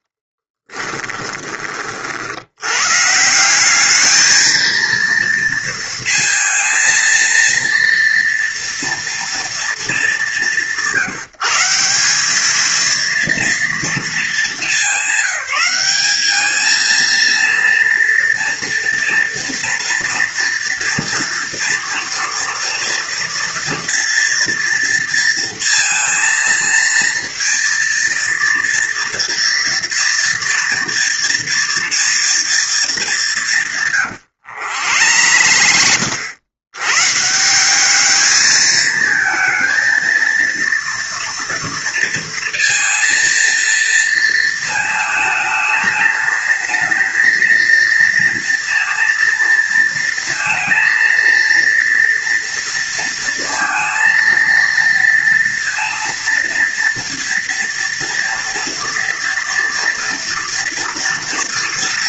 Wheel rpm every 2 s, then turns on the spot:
10, 110, 230, 230, 230, 170, 220, 210, 220, 230, 230, 240, 230, 230, 230, 230, 230, 110, 110, 220, 230, 230, 220, 220, 230, 230, 230, 230, 230, 230, 230.
0-2 34-36